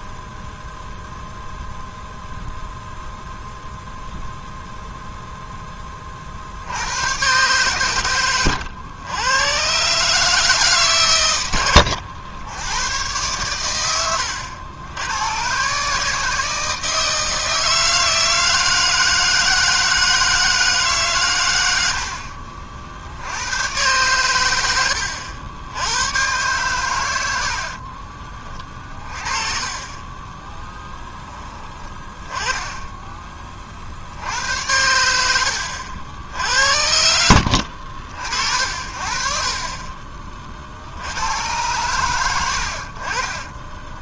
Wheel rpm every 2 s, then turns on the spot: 0, 0, 0, 90, 100, 130, 100, 90, 160, 160, 150, 60, 90, 110, 30, 10, 10, 90, 70, 50, 70, 50.
24-26 32-34